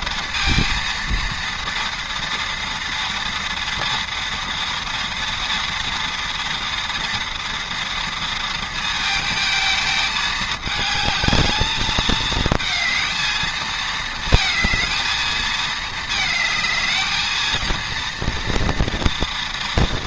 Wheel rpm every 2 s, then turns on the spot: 230, 230, 230, 230, 220, 220, 220, 220, 230, 230.
none